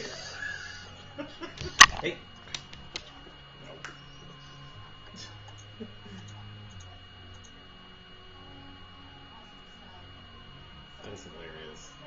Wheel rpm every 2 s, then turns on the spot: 0, 0, 0, 0, 0, 0.
none